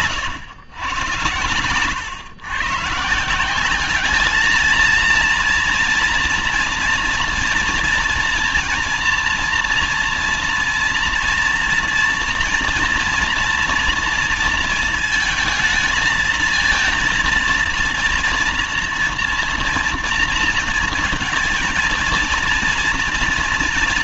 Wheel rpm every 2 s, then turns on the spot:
120, 120, 220, 230, 240, 240, 240, 230, 230, 240, 230, 230.
none